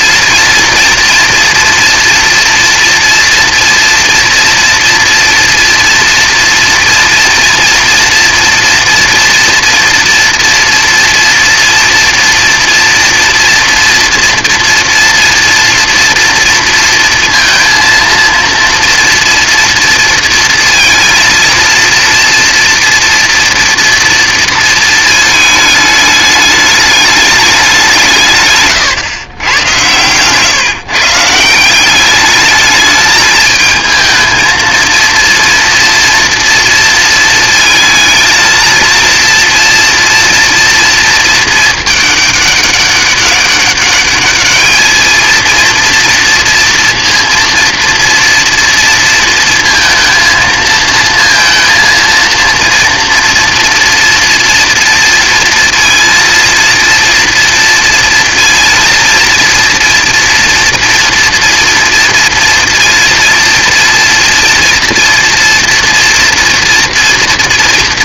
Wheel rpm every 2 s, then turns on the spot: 240, 230, 230, 230, 240, 230, 230, 240, 230, 230, 230, 230, 220, 210, 140, 140, 210, 230, 230, 230, 230, 200, 210, 230, 230, 220, 230, 230, 230, 230, 240, 230, 230, 230.
28-30